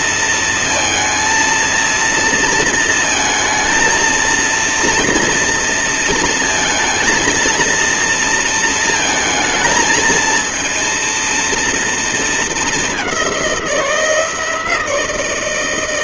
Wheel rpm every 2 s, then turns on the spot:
230, 230, 230, 230, 220, 230, 200, 160.
none